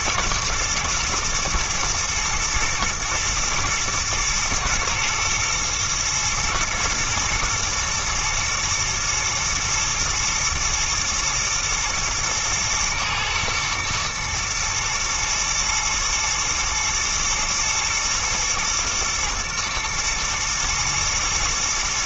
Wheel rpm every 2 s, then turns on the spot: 120, 120, 110, 120, 110, 110, 110, 120, 110, 120, 120.
none